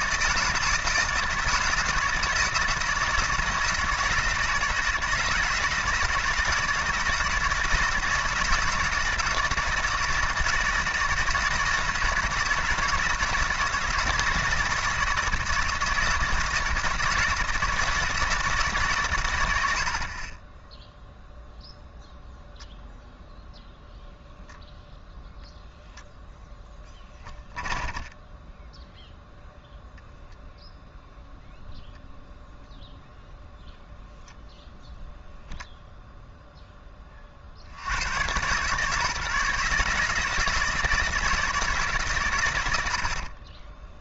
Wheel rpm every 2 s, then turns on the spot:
160, 160, 160, 160, 160, 160, 160, 160, 160, 150, 10, 0, 0, 10, 0, 0, 0, 0, 0, 140, 160, 80.
none